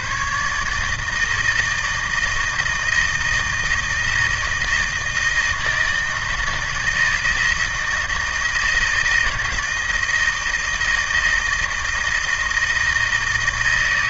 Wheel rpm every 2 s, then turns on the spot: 150, 160, 160, 160, 160, 160, 160.
none